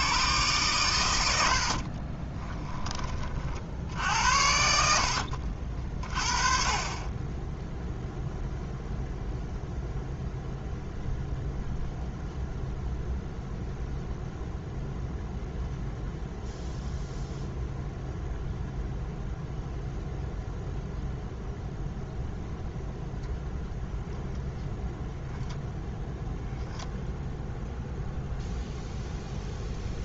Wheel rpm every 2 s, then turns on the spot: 120, 20, 70, 30, 0, 0, 0, 0, 0, 0, 0, 0, 0, 0, 0.
2-4